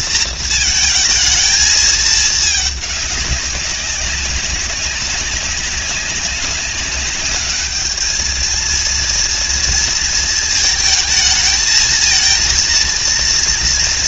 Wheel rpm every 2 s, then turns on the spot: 220, 200, 200, 200, 230, 220, 230.
none